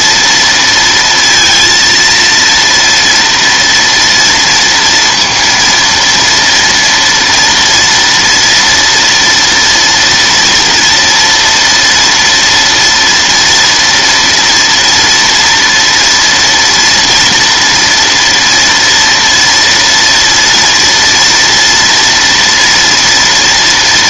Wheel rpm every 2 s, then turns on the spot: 230, 230, 230, 230, 240, 230, 230, 230, 230, 240, 230, 230.
none